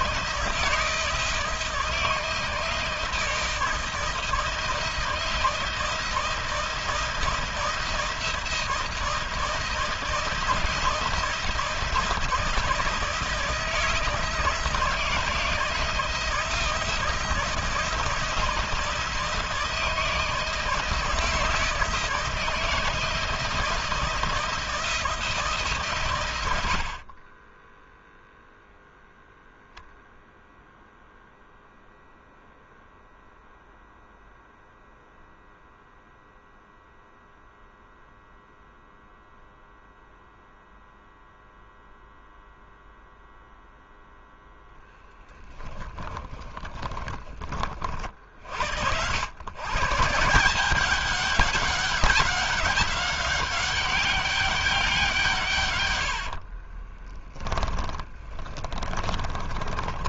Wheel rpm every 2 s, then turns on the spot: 160, 160, 160, 160, 160, 160, 160, 160, 160, 160, 160, 160, 160, 50, 0, 0, 0, 0, 0, 0, 0, 0, 0, 20, 90, 190, 200, 170, 20, 30.
46-48 56-60